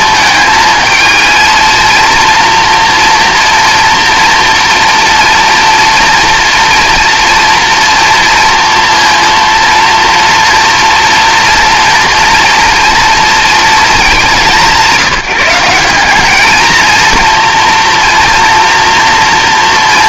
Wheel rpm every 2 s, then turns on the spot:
220, 240, 230, 230, 230, 230, 230, 180, 220, 230.
none